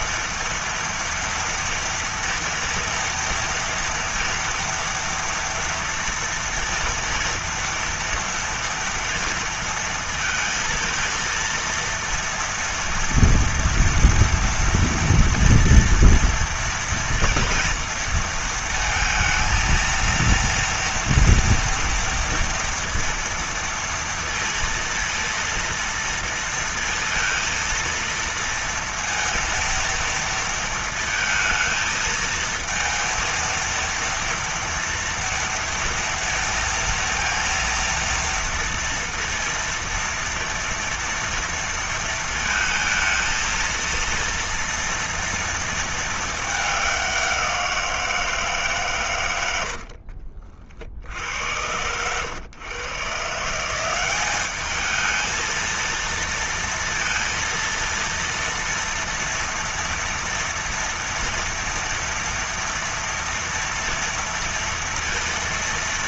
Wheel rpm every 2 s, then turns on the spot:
230, 230, 230, 230, 230, 230, 230, 230, 230, 230, 230, 230, 230, 230, 230, 230, 220, 230, 230, 230, 230, 230, 230, 210, 160, 60, 110, 190, 230, 230, 230, 230, 230.
50-52